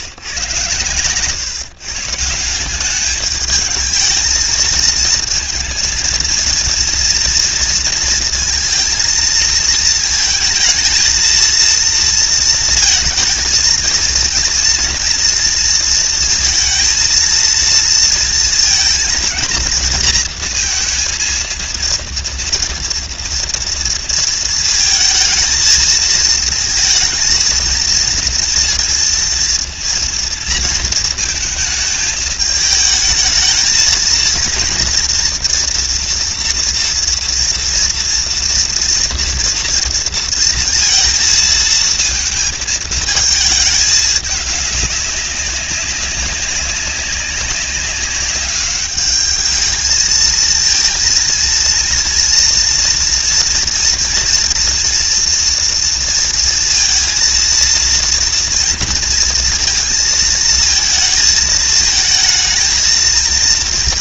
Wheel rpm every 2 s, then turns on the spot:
130, 210, 230, 230, 230, 230, 230, 230, 230, 230, 230, 230, 230, 230, 230, 230, 220, 230, 230, 230, 230, 220, 200, 200, 210, 230, 230, 240, 230, 230, 220, 220.
none